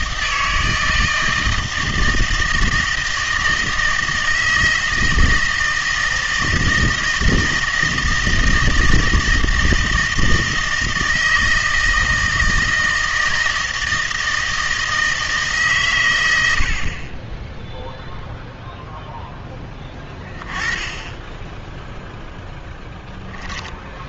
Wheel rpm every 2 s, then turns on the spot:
160, 160, 160, 160, 160, 160, 160, 160, 70, 0, 20, 10.
none